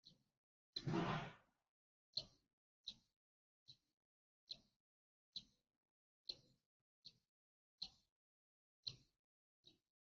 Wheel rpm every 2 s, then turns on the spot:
0, 0, 0, 0, 0.
none